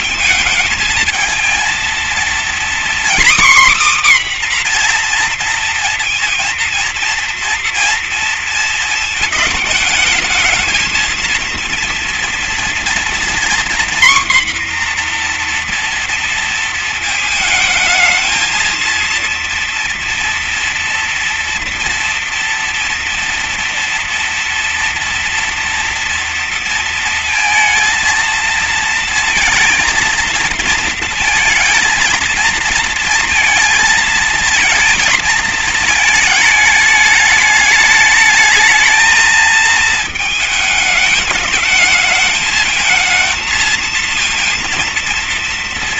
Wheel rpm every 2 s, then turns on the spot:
230, 260, 240, 230, 220, 230, 240, 250, 220, 230, 230, 230, 230, 230, 230, 230, 230, 230, 210, 220, 220, 230, 230.
none